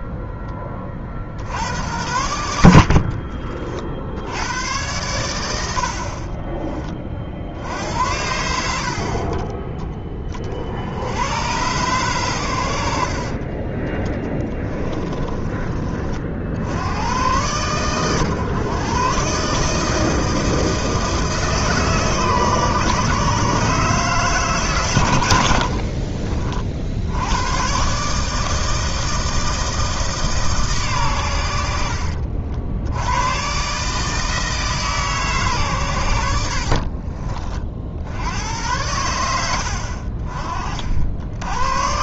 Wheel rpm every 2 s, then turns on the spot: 20, 70, 100, 20, 60, 50, 90, 20, 70, 130, 160, 140, 140, 50, 160, 140, 70, 160, 60, 90, 60.
14-16 36-38